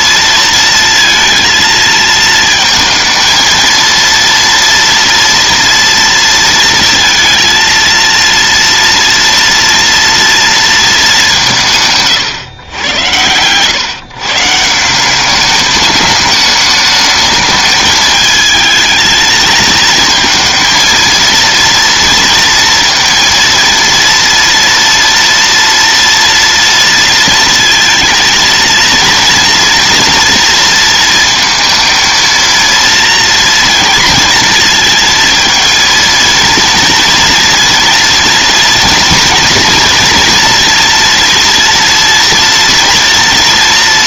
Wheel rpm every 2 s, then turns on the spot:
230, 230, 230, 230, 230, 220, 110, 170, 210, 220, 230, 230, 230, 230, 230, 230, 230, 230, 230, 230, 230, 230.
none